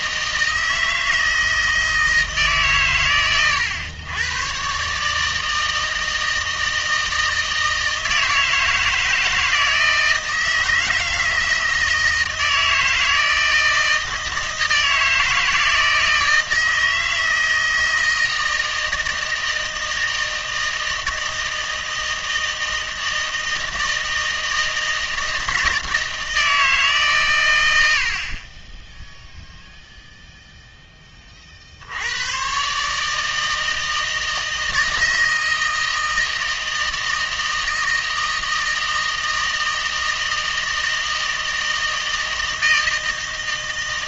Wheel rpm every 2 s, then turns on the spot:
160, 130, 140, 160, 160, 160, 160, 160, 160, 160, 160, 160, 160, 160, 20, 10, 140, 160, 160, 160, 160, 160.
none